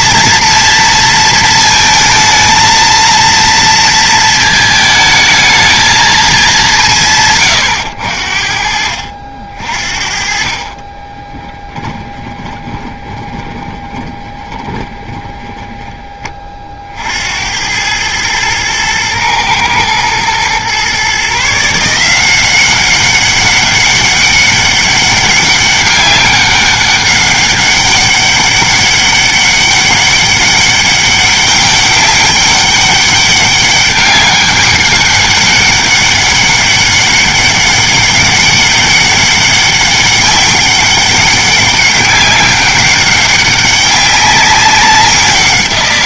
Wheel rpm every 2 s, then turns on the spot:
230, 230, 220, 180, 60, 40, 20, 20, 50, 110, 120, 190, 200, 200, 200, 200, 200, 200, 200, 200, 200, 200, 200.
12-16